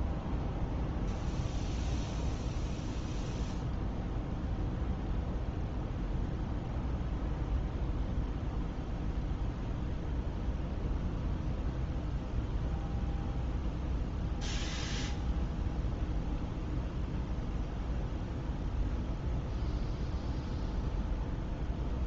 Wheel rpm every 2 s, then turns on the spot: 0, 0, 0, 0, 0, 0, 0, 0, 0, 0, 0.
none